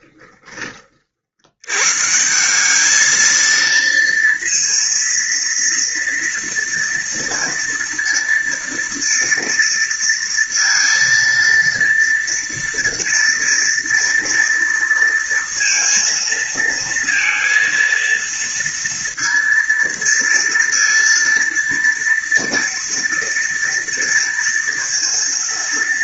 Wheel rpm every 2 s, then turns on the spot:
30, 180, 230, 230, 230, 230, 230, 230, 230, 230, 230, 230, 230.
none